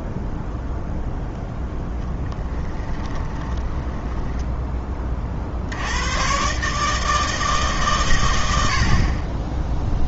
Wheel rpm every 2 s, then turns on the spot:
0, 20, 10, 140, 80.
2-4